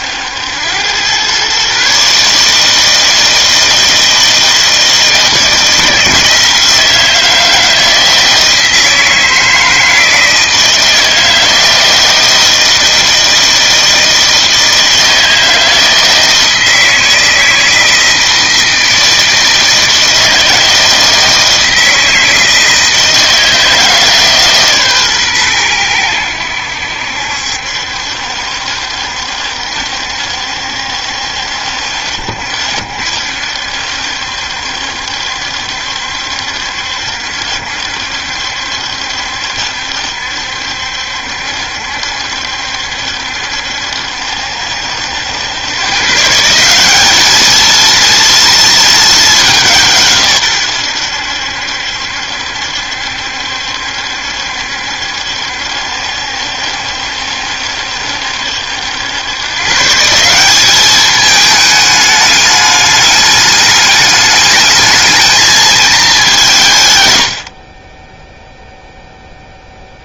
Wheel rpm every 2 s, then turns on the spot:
90, 150, 160, 160, 160, 160, 160, 160, 160, 160, 160, 160, 140, 80, 70, 70, 60, 70, 70, 70, 70, 70, 70, 170, 230, 120, 70, 70, 70, 70, 190, 210, 210, 170, 0.
none